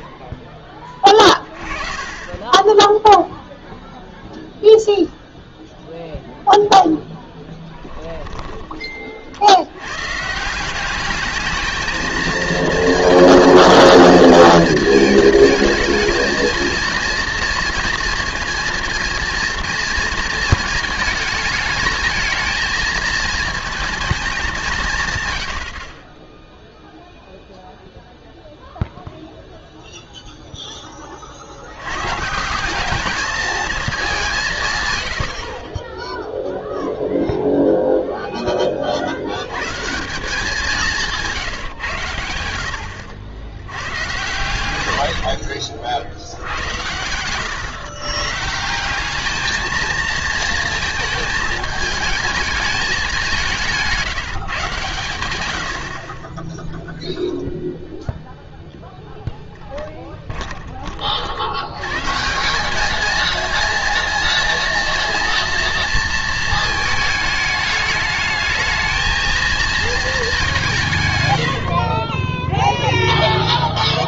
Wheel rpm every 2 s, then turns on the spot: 20, 10, 0, 0, 20, 180, 230, 230, 230, 230, 220, 220, 170, 0, 0, 10, 180, 140, 0, 40, 190, 80, 110, 100, 170, 220, 210, 130, 0, 0, 30, 200, 230, 220, 220, 160, 0.
0-4 44-48